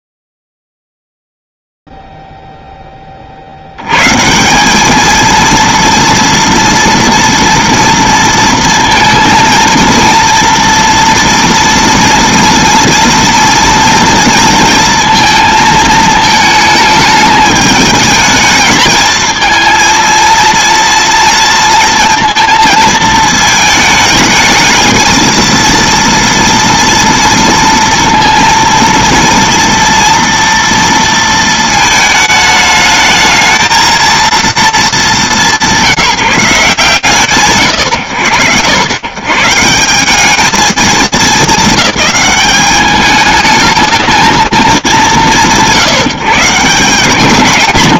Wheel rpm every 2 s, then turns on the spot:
0, 0, 80, 230, 230, 230, 230, 230, 220, 210, 220, 230, 220, 230, 230, 230, 220, 220, 180, 90, 200, 210, 170, 200.
none